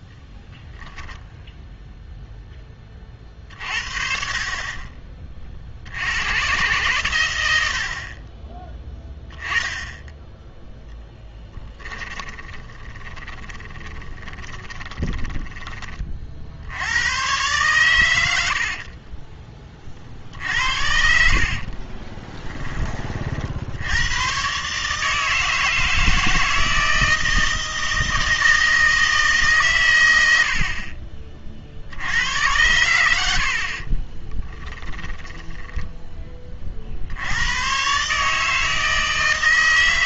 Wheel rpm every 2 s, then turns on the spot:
10, 10, 30, 120, 10, 0, 20, 20, 70, 60, 70, 10, 130, 160, 160, 60, 90, 10, 30, 160.
12-16 18-22 34-36